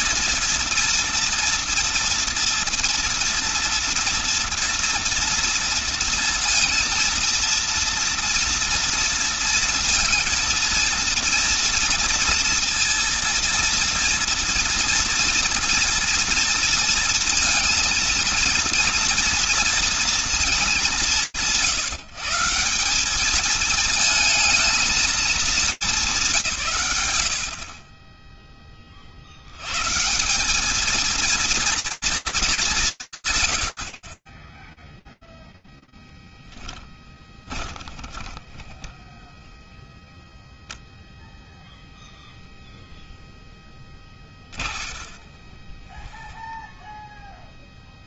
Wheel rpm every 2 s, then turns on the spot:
230, 230, 230, 230, 230, 230, 230, 230, 230, 230, 170, 190, 230, 130, 50, 220, 200, 10, 20, 10, 0, 10, 20, 10.
36-40 42-46